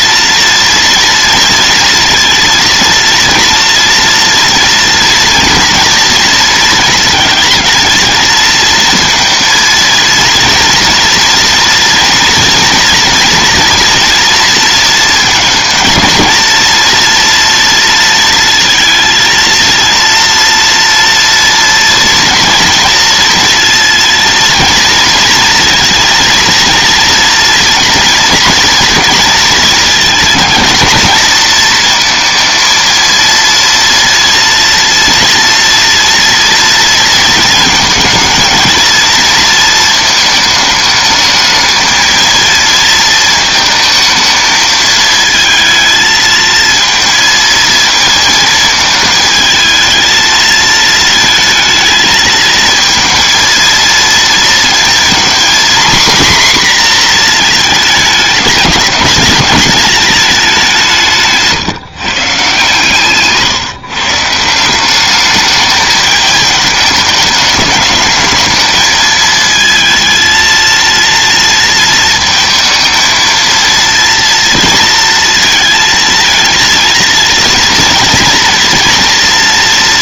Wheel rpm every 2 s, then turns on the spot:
230, 230, 230, 230, 230, 230, 230, 230, 230, 230, 230, 230, 230, 230, 230, 220, 230, 240, 230, 230, 220, 220, 220, 230, 220, 220, 220, 230, 240, 220, 170, 150, 190, 210, 220, 230, 220, 230, 230, 230.
none